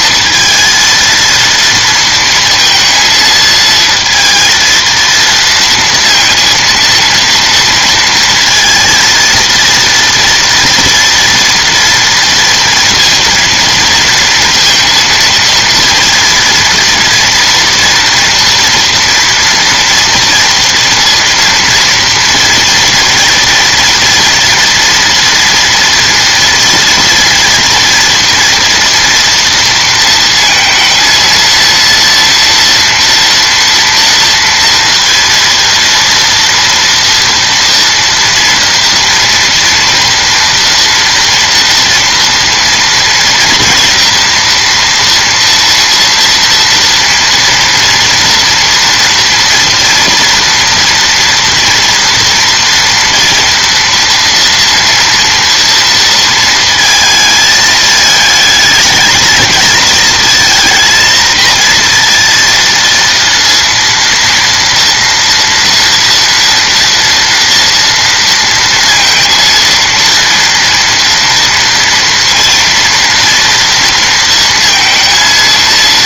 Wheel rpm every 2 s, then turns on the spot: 230, 230, 230, 230, 230, 240, 230, 230, 230, 230, 230, 230, 230, 230, 230, 230, 230, 230, 230, 230, 230, 230, 240, 240, 240, 240, 230, 230, 230, 220, 230, 230, 230, 230, 230, 230, 230, 230.
none